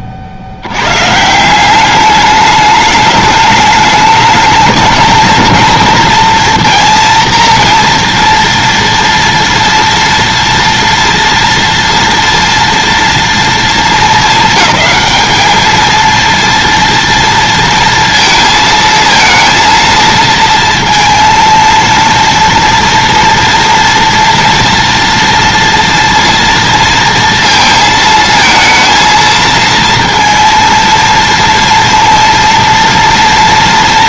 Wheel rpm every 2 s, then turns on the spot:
90, 210, 220, 230, 230, 230, 230, 200, 230, 220, 230, 230, 230, 230, 230, 230, 230.
none